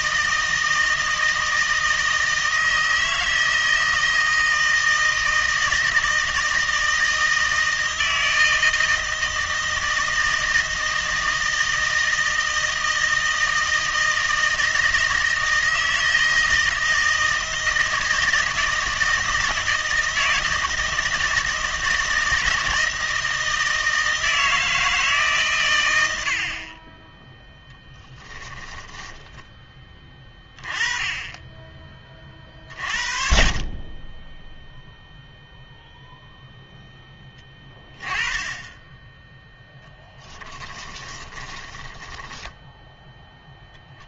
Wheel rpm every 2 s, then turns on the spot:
160, 160, 160, 160, 160, 160, 160, 160, 160, 160, 160, 160, 160, 40, 20, 20, 40, 0, 0, 20, 20, 10.
28-30 40-44